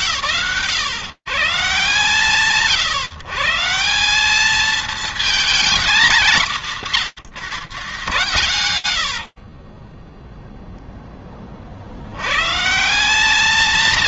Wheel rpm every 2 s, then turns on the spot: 140, 180, 240, 170, 20, 100, 200.
none